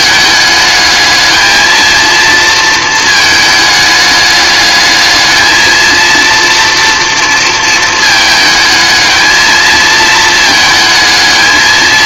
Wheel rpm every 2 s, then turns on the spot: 220, 220, 210, 230, 220, 220.
none